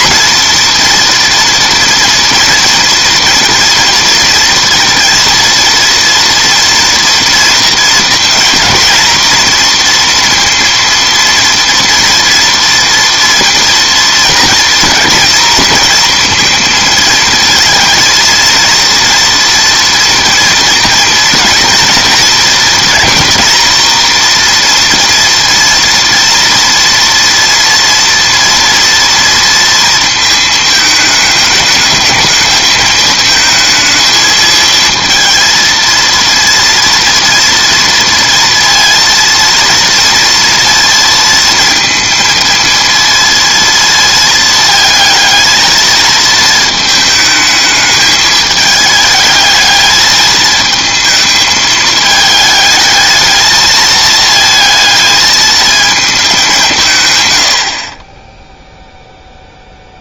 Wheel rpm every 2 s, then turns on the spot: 240, 230, 230, 230, 230, 230, 230, 230, 230, 230, 230, 240, 240, 230, 230, 220, 220, 220, 230, 230, 230, 230, 220, 220, 220, 220, 210, 220, 200, 0.
none